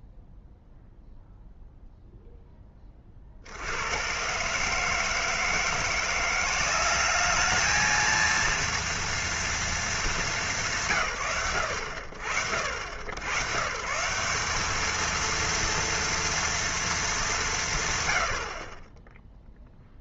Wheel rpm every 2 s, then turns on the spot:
0, 10, 140, 190, 230, 210, 100, 200, 230, 60.
none